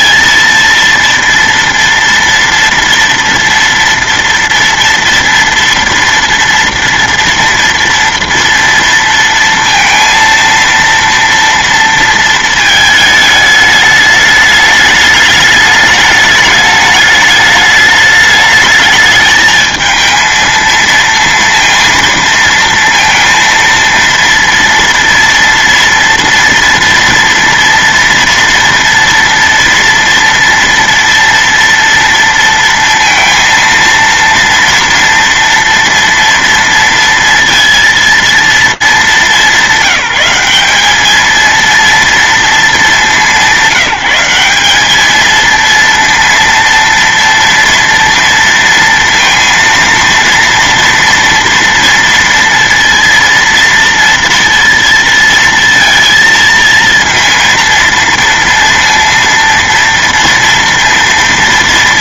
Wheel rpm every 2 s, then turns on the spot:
230, 230, 230, 230, 230, 230, 220, 210, 210, 210, 220, 230, 230, 240, 230, 230, 230, 230, 230, 210, 200, 220, 190, 230, 230, 230, 230, 230, 230, 230, 230.
none